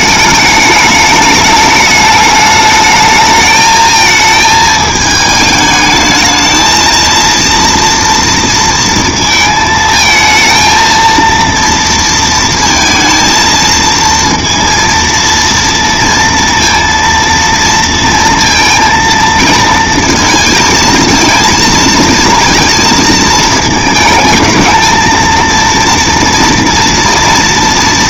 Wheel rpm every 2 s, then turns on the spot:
210, 220, 210, 230, 230, 230, 230, 230, 230, 230, 230, 230, 230, 230.
none